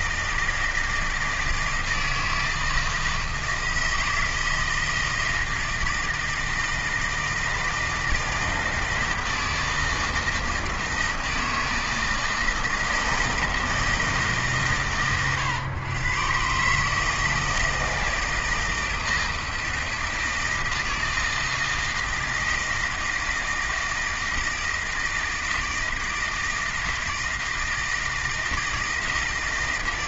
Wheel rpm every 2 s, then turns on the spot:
160, 160, 160, 160, 160, 160, 160, 140, 140, 160, 160, 160, 160, 160, 160.
none